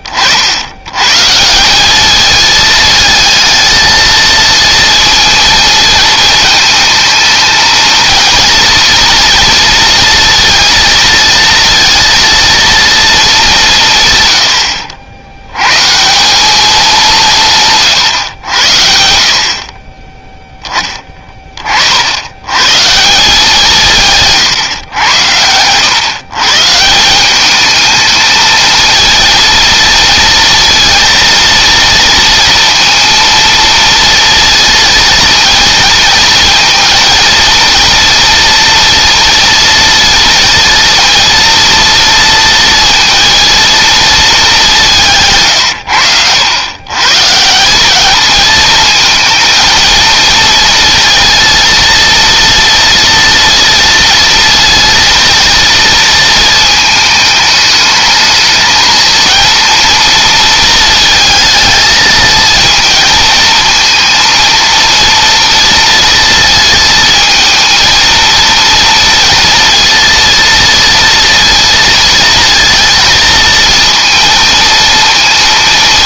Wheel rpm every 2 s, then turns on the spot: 60, 220, 230, 220, 230, 230, 230, 100, 200, 100, 10, 130, 120, 140, 230, 230, 230, 230, 230, 230, 230, 230, 190, 110, 220, 230, 230, 230, 220, 230, 230, 230, 230, 220, 230, 230, 230, 230.
none